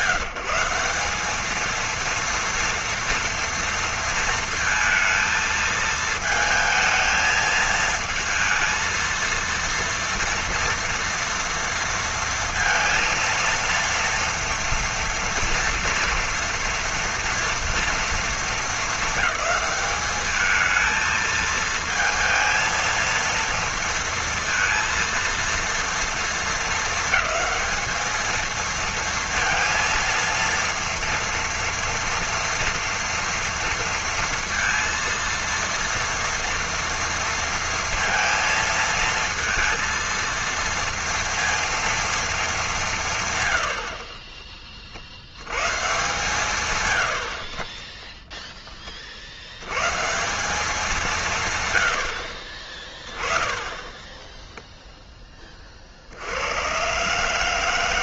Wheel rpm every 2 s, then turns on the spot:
180, 230, 230, 220, 220, 230, 230, 230, 230, 220, 220, 220, 230, 220, 230, 230, 230, 230, 230, 230, 230, 200, 30, 140, 10, 190, 30, 0, 100.
none